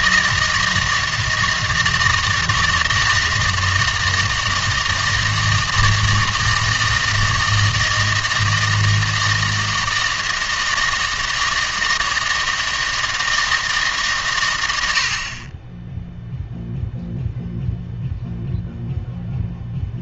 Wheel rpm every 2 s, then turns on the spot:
160, 160, 160, 160, 160, 160, 160, 90, 0, 0.
none